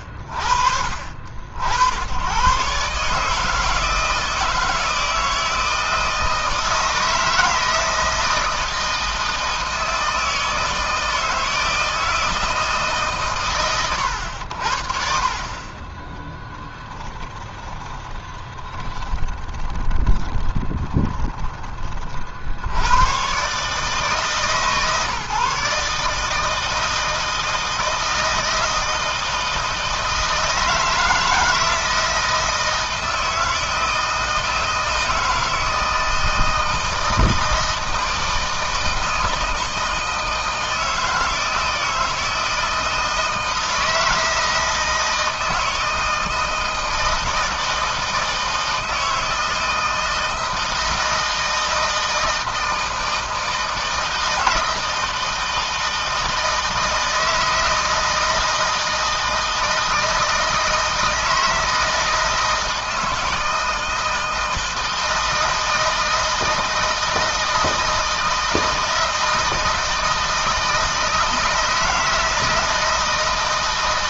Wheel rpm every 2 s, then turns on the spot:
60, 140, 160, 160, 160, 160, 150, 50, 10, 20, 20, 100, 140, 160, 160, 160, 160, 160, 160, 160, 160, 160, 160, 160, 160, 160, 160, 160, 160, 160, 160, 160, 160, 160, 160, 160, 160.
16-22